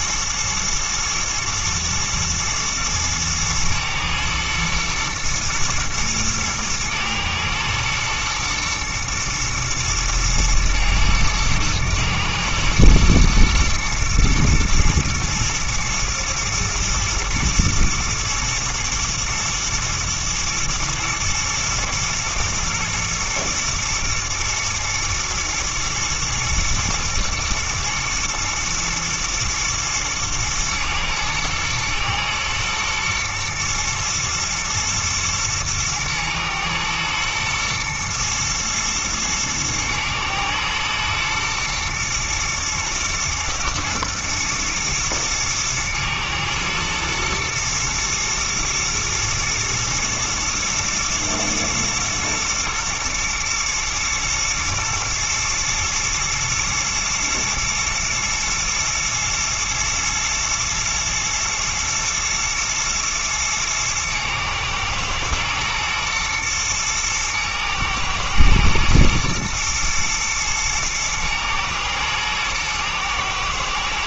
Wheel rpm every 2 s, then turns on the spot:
120, 110, 110, 120, 110, 110, 110, 120, 110, 110, 110, 120, 110, 110, 110, 110, 120, 120, 110, 120, 110, 120, 120, 110, 110, 120, 110, 120, 110, 120, 110, 110, 110, 120, 110, 120, 110.
none